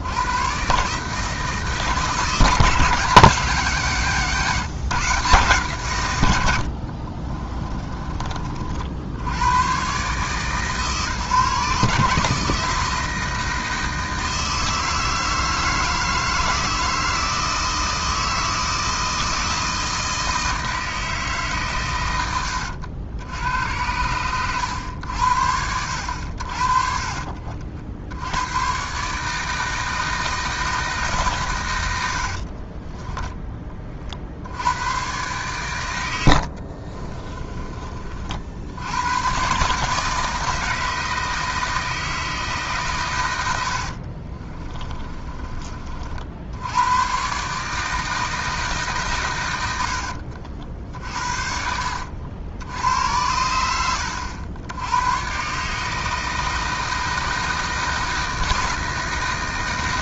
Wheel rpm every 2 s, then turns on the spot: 140, 160, 150, 60, 60, 140, 160, 160, 160, 160, 160, 80, 100, 50, 130, 160, 50, 90, 50, 70, 160, 140, 30, 90, 150, 60, 80, 90, 160, 160.
6-8 32-34 36-38 44-46